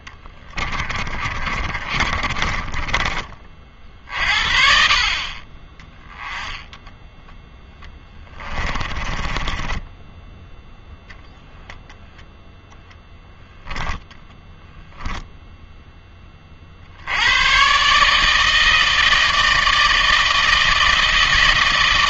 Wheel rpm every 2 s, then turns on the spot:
30, 40, 40, 10, 20, 0, 0, 10, 40, 160, 160.
0-4 8-10